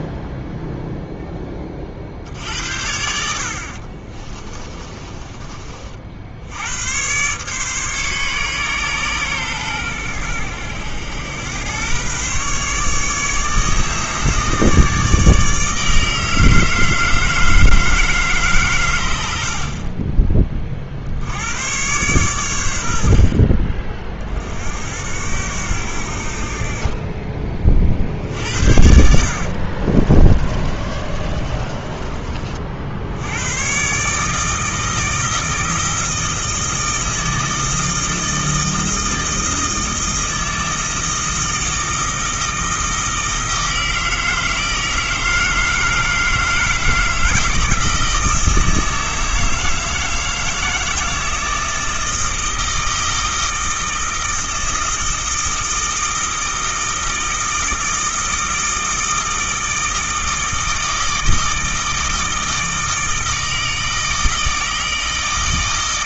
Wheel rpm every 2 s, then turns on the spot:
0, 70, 20, 110, 130, 90, 150, 150, 160, 100, 60, 70, 70, 30, 70, 30, 80, 160, 160, 160, 160, 160, 160, 160, 160, 160, 160, 160, 160, 160, 160, 160, 160.
4-6 28-32